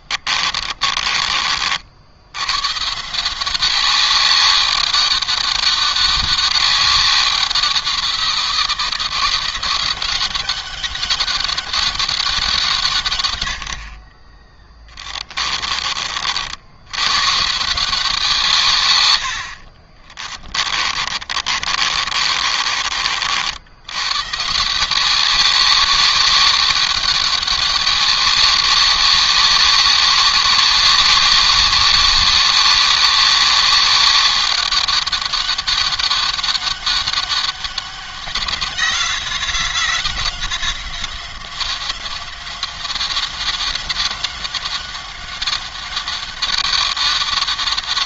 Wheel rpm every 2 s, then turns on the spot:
30, 150, 200, 190, 170, 200, 140, 20, 110, 110, 30, 60, 180, 200, 200, 200, 200, 200, 200, 180, 180, 190, 190, 200.
14-16 20-22